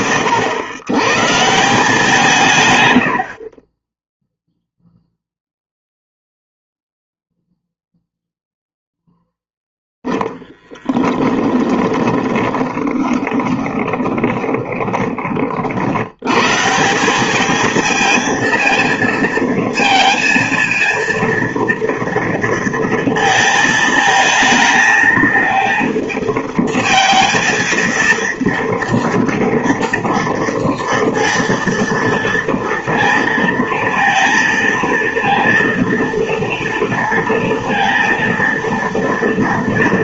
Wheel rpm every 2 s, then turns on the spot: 110, 110, 0, 0, 0, 10, 20, 30, 160, 230, 230, 230, 220, 220, 230, 230, 230, 230, 230, 230.
12-16